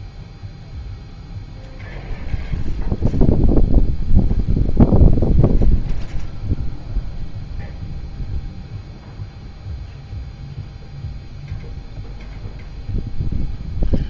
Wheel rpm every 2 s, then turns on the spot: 0, 0, 0, 0, 0, 0, 0.
none